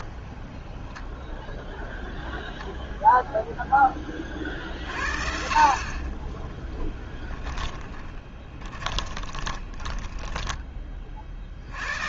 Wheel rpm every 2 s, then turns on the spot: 10, 0, 60, 10, 10, 20.
6-10